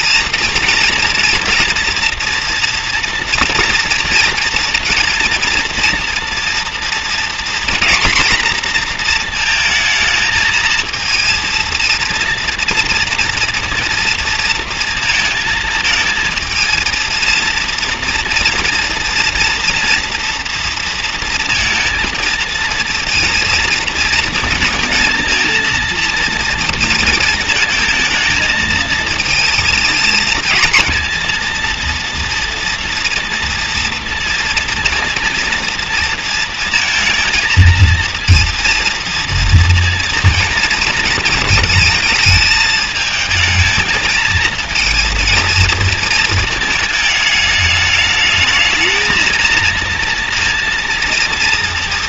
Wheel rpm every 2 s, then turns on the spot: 230, 230, 230, 240, 230, 230, 230, 230, 230, 230, 230, 230, 230, 230, 230, 230, 230, 230, 230, 230, 230, 220, 230, 220, 220, 230.
none